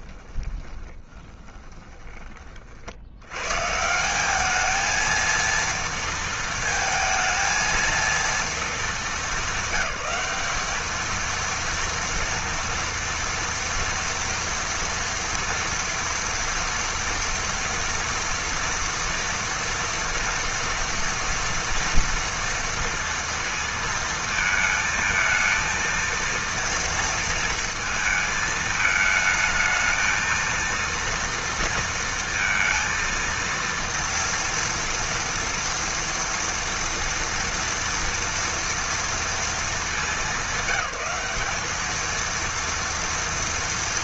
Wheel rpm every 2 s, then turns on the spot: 20, 40, 220, 230, 220, 210, 230, 240, 230, 230, 230, 230, 220, 230, 220, 230, 230, 230, 230, 230, 200, 230.
0-2